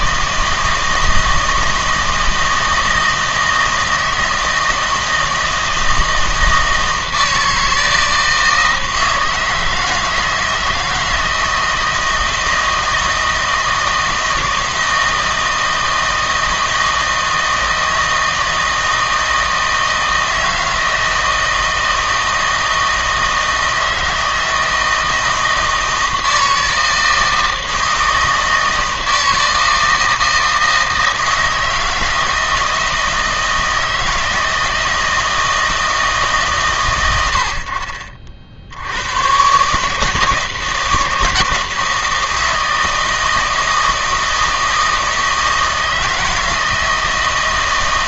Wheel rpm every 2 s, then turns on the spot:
160, 160, 160, 160, 160, 160, 160, 160, 160, 160, 160, 160, 160, 160, 160, 160, 160, 160, 120, 90, 160, 160, 160, 160.
none